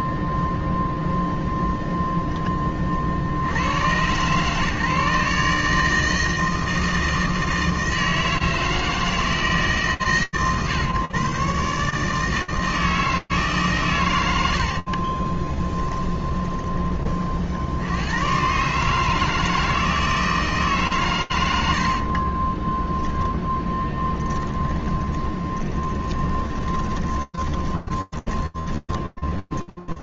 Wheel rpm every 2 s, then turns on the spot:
0, 110, 150, 160, 140, 150, 130, 20, 70, 160, 60, 10, 20, 10, 10.
14-16 20-30